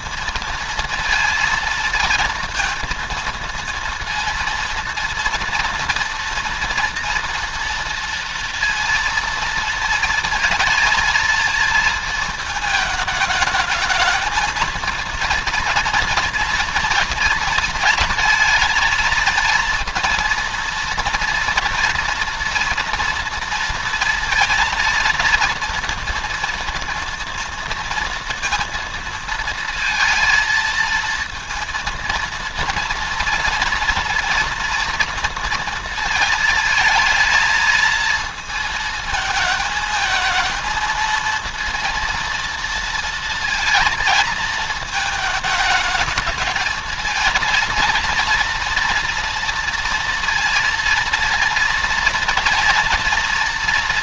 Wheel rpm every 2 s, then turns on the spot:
230, 230, 230, 230, 230, 230, 220, 220, 230, 230, 230, 230, 230, 230, 230, 230, 230, 230, 220, 220, 230, 230, 220, 220, 230, 230, 230.
none